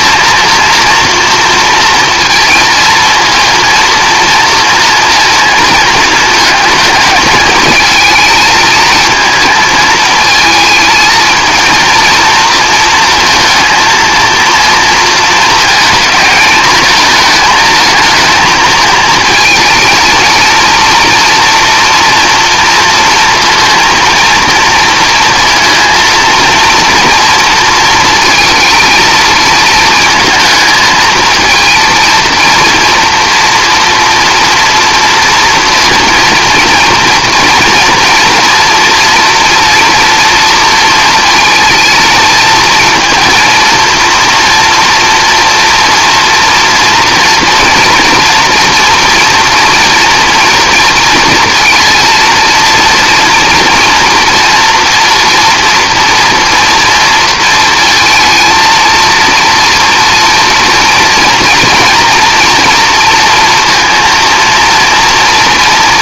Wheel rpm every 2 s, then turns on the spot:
230, 230, 230, 220, 220, 220, 230, 230, 220, 220, 230, 230, 230, 230, 230, 220, 240, 230, 230, 230, 230, 230, 230, 240, 230, 240, 230, 230, 230, 230, 230, 240, 230.
none